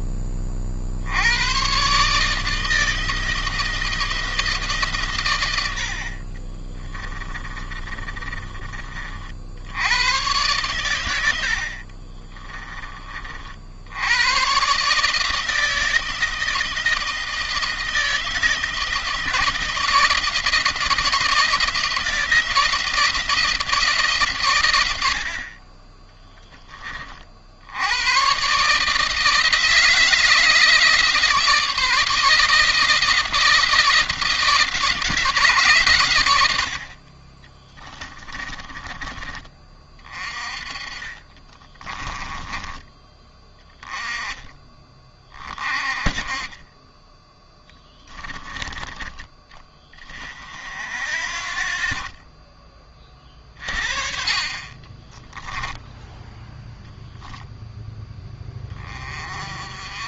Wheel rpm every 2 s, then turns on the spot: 60, 160, 140, 20, 50, 110, 30, 140, 160, 160, 170, 170, 100, 30, 150, 160, 170, 170, 70, 20, 30, 20, 20, 10, 20, 60, 30, 20, 0, 20.
6-8 40-42 54-56